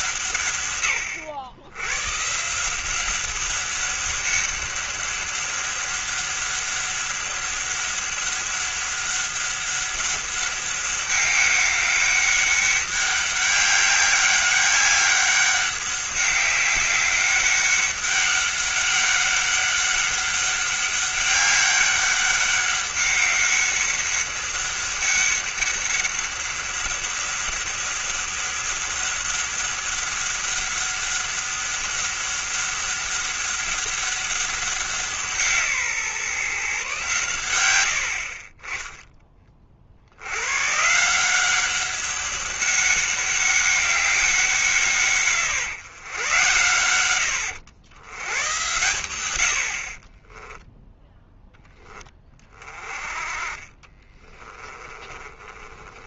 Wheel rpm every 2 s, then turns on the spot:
130, 170, 200, 200, 200, 200, 200, 200, 200, 200, 200, 200, 200, 200, 200, 200, 200, 180, 140, 20, 130, 200, 160, 100, 100, 10, 30, 20.
54-56